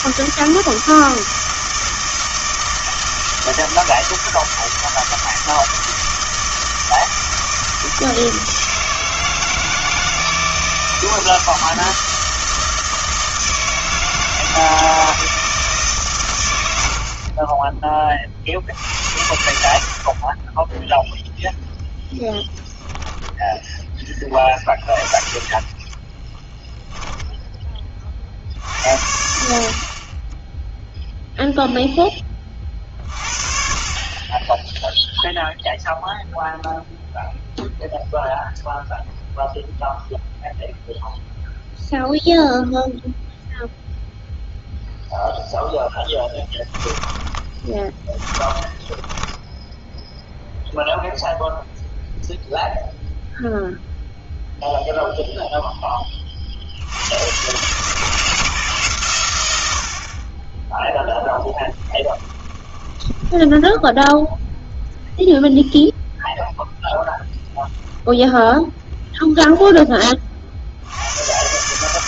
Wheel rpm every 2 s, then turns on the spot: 160, 160, 160, 160, 160, 160, 160, 160, 90, 70, 10, 0, 20, 20, 60, 0, 40, 10, 0, 0, 0, 0, 10, 10, 20, 0, 0, 0, 60, 140, 10, 20, 0, 0, 0, 60.
26-28 46-50 62-64